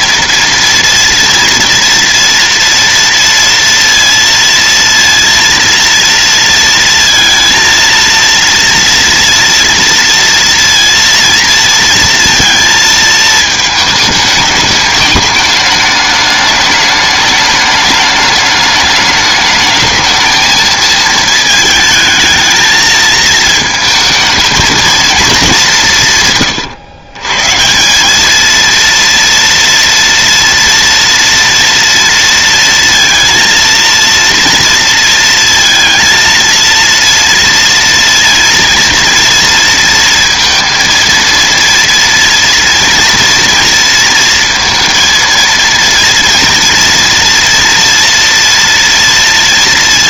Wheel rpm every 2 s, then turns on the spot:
230, 230, 230, 230, 230, 230, 230, 210, 210, 210, 220, 220, 220, 120, 220, 230, 230, 230, 230, 230, 230, 230, 230, 230, 230.
none